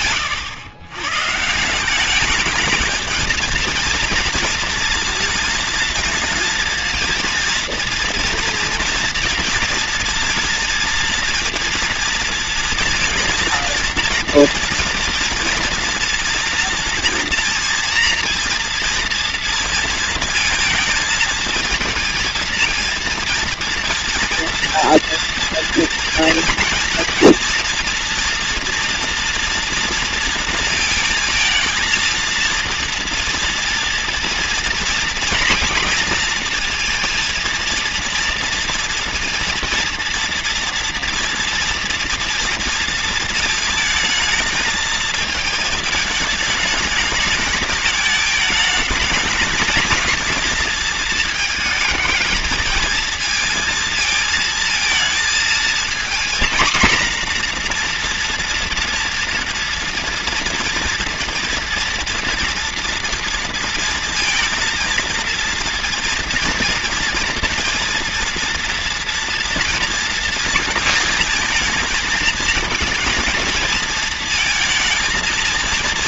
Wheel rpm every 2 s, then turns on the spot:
140, 220, 230, 230, 230, 230, 230, 230, 240, 240, 230, 230, 230, 230, 230, 220, 230, 230, 230, 230, 240, 220, 220, 210, 220, 220, 230, 220, 230, 230, 230, 230, 230, 230, 230, 220, 230, 220.
none